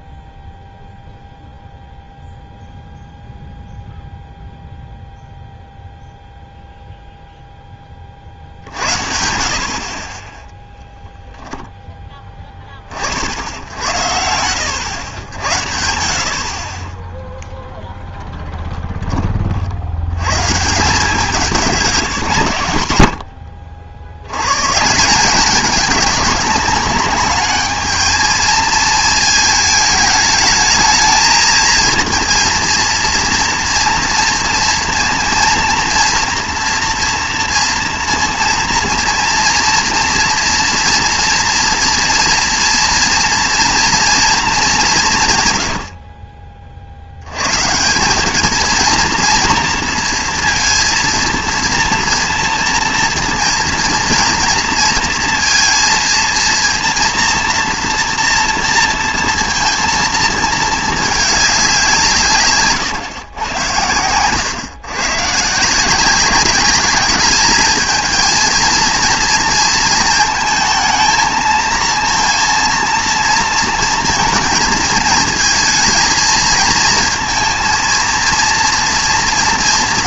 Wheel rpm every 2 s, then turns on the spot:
0, 0, 0, 0, 60, 0, 40, 90, 20, 10, 160, 120, 140, 200, 220, 220, 230, 230, 230, 230, 230, 230, 200, 50, 220, 230, 230, 230, 230, 230, 220, 130, 130, 200, 230, 230, 230, 230, 230, 230.
none